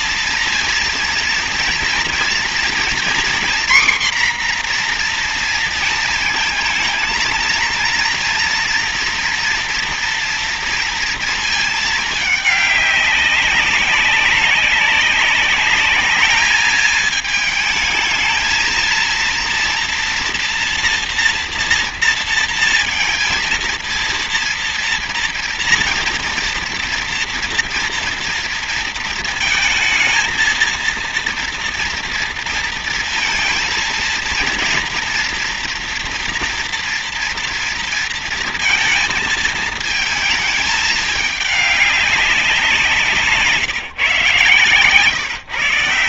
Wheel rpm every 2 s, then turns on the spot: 230, 240, 240, 230, 230, 230, 200, 190, 220, 230, 230, 230, 230, 230, 230, 230, 230, 230, 230, 230, 210, 180, 130.
none